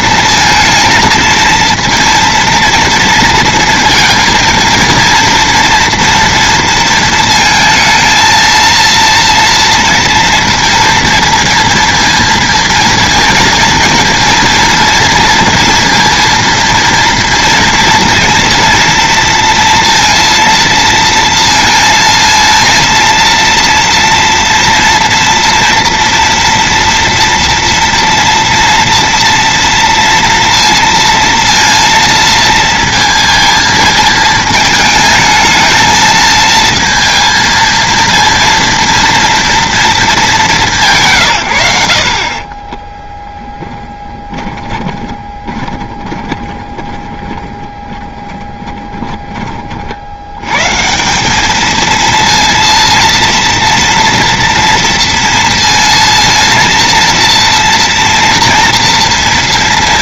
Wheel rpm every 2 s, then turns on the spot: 230, 230, 230, 230, 230, 230, 230, 230, 230, 230, 230, 230, 230, 230, 230, 230, 230, 220, 220, 230, 190, 40, 10, 20, 10, 120, 230, 230, 230, 230.
42-50